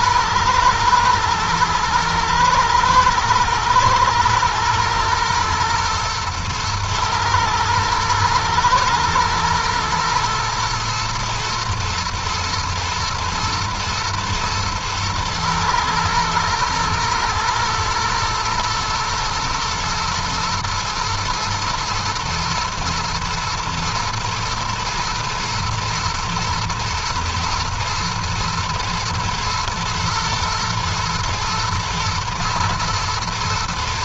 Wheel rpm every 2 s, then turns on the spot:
120, 110, 120, 110, 120, 120, 110, 110, 120, 120, 110, 110, 110, 110, 120, 120, 120.
none